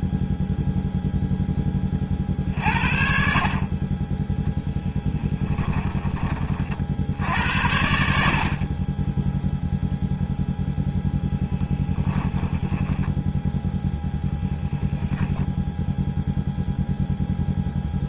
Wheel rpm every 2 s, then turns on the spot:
0, 10, 40, 10, 80, 0, 20, 0, 0.
6-8 12-14